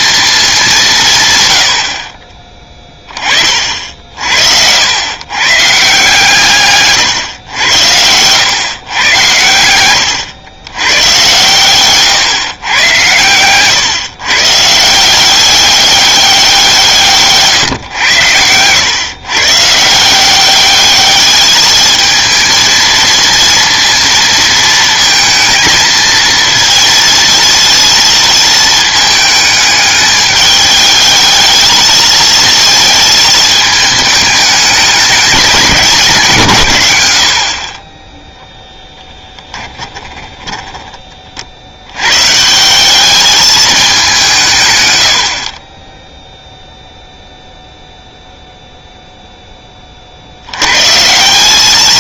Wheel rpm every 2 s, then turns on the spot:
200, 20, 90, 140, 120, 110, 120, 160, 170, 110, 200, 230, 230, 230, 220, 210, 220, 210, 120, 10, 10, 170, 130, 0, 0, 100.
none